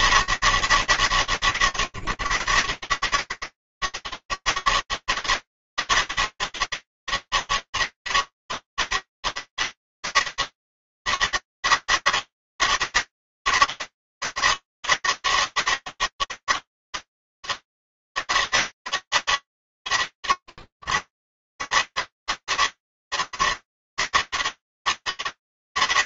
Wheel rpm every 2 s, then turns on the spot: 200, 160, 200, 200, 200, 200, 200, 200, 200, 200, 90, 190, 180.
none